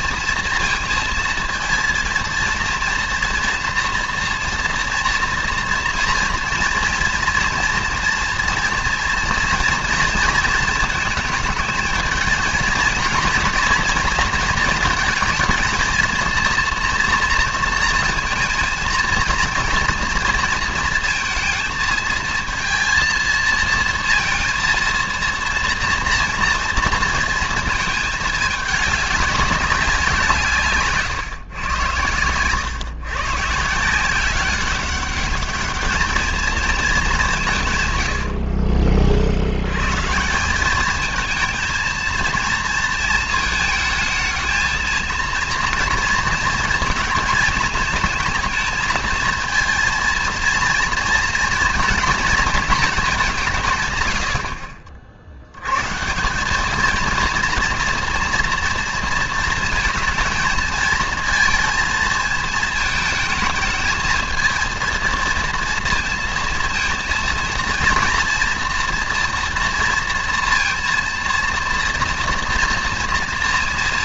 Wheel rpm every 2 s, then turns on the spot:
230, 230, 230, 240, 230, 220, 230, 220, 230, 230, 230, 230, 230, 230, 200, 140, 130, 200, 210, 50, 220, 230, 230, 230, 230, 230, 210, 60, 230, 230, 230, 220, 230, 230, 230, 230, 230.
none